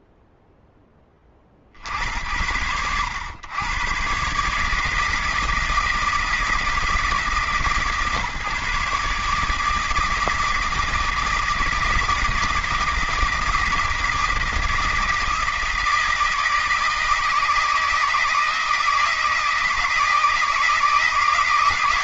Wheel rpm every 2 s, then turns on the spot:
50, 120, 160, 140, 160, 160, 160, 160, 160, 160, 160.
none